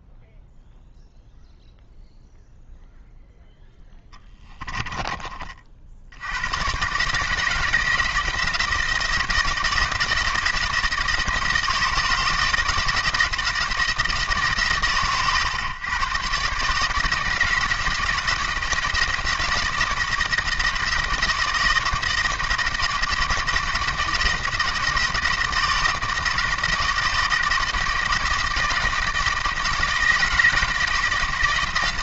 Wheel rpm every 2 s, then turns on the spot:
0, 0, 20, 120, 160, 160, 160, 130, 150, 170, 160, 160, 160, 160, 160, 160.
4-6